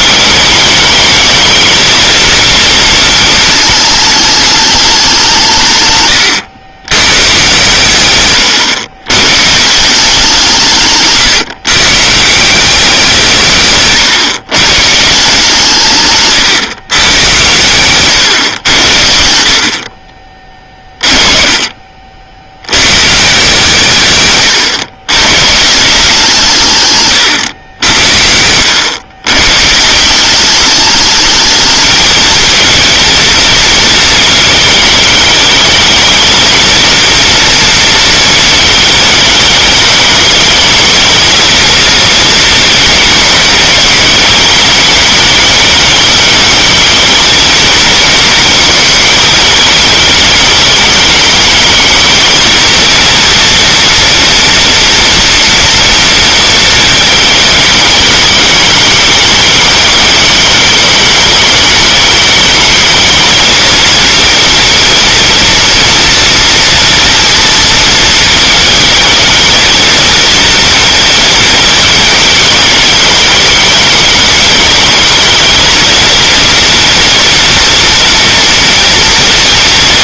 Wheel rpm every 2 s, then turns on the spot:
210, 230, 210, 110, 120, 150, 180, 130, 130, 100, 20, 90, 120, 140, 90, 200, 220, 220, 230, 220, 210, 220, 210, 220, 220, 210, 230, 230, 230, 210, 210, 210, 230, 230, 220, 230, 210, 210, 230, 240.
8-10